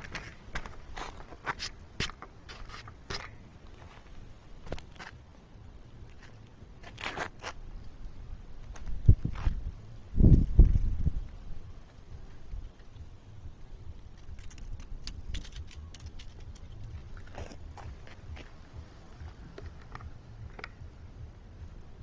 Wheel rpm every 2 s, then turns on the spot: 0, 0, 0, 0, 0, 0, 0, 0, 0, 0, 0.
none